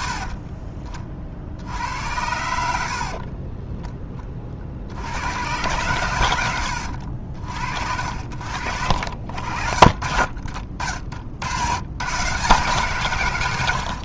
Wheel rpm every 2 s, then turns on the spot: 40, 70, 60, 80, 70, 60, 140.
2-4